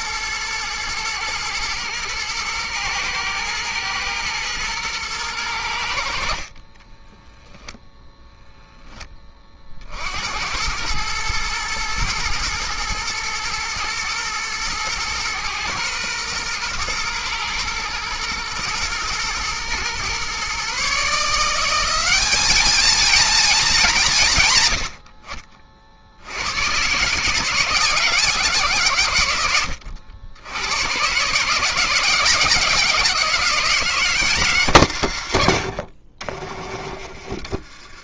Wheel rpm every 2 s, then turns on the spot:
110, 110, 40, 0, 90, 110, 110, 120, 110, 130, 210, 130, 80, 160, 80, 160, 190, 50, 40.
4-6